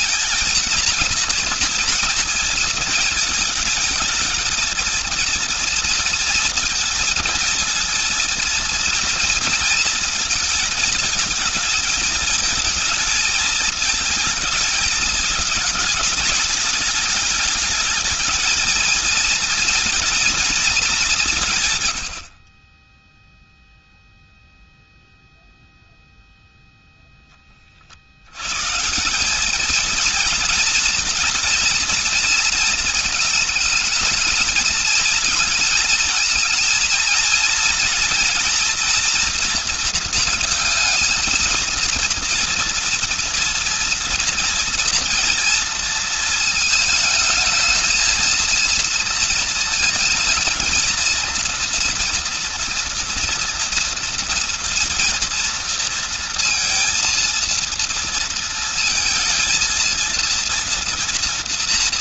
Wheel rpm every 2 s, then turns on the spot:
230, 230, 230, 230, 230, 220, 220, 220, 210, 220, 230, 50, 0, 0, 130, 230, 220, 220, 230, 230, 220, 230, 230, 230, 230, 230, 230, 230, 230, 230, 230.
22-24